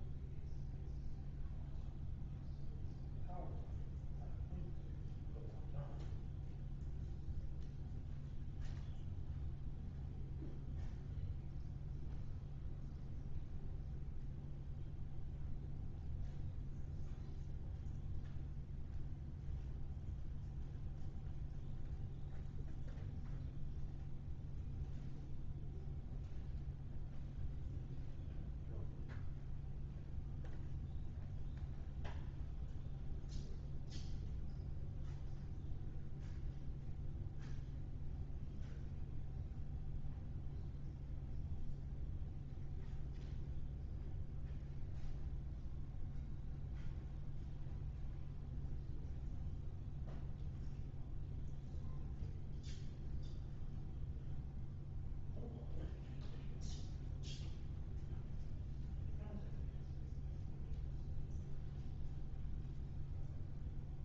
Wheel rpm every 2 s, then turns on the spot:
0, 0, 0, 0, 0, 0, 0, 0, 0, 0, 0, 0, 0, 0, 0, 0, 0, 0, 0, 0, 0, 0, 0, 0, 0, 0, 0, 0, 0, 0, 0, 0.
none